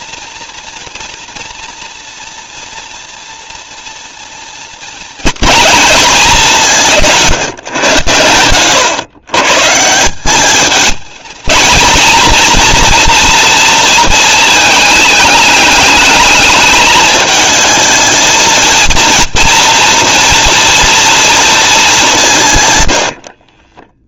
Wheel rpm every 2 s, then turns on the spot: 240, 230, 240, 200, 120, 210, 230, 220, 220, 230, 230, 110.
none